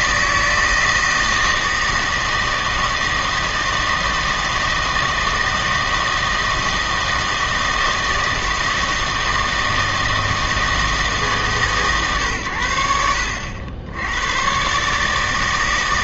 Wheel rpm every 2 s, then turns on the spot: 160, 160, 160, 160, 160, 160, 110, 120.
none